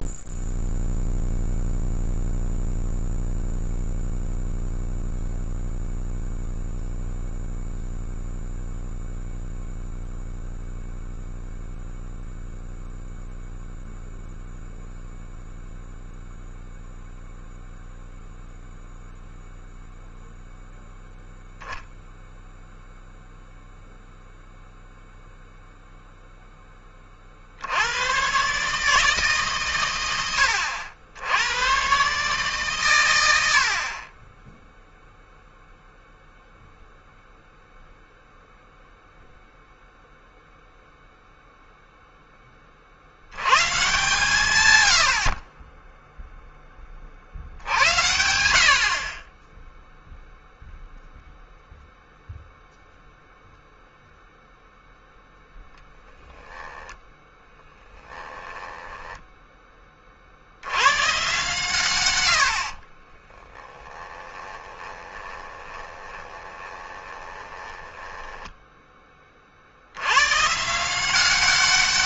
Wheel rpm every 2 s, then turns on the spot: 0, 0, 0, 0, 0, 0, 0, 0, 0, 0, 0, 0, 0, 10, 140, 80, 130, 10, 0, 0, 0, 30, 110, 10, 60, 0, 0, 0, 10, 10, 70, 60, 20, 20, 10, 140.
58-60 62-68